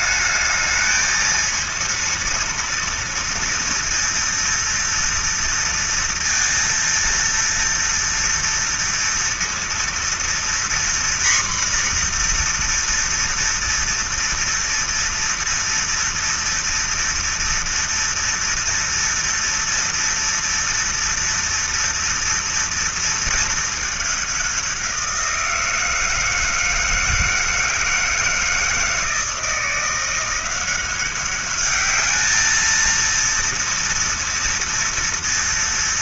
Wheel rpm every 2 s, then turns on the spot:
220, 230, 230, 230, 230, 240, 240, 230, 230, 230, 240, 240, 200, 160, 160, 170, 210, 230.
none